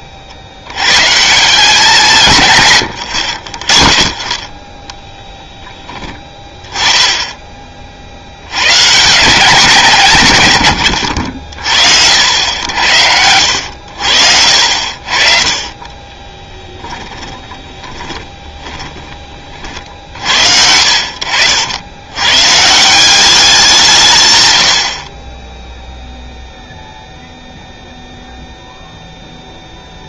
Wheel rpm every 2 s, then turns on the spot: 90, 120, 10, 10, 100, 110, 90, 60, 10, 20, 60, 150, 90, 0, 0.
16-20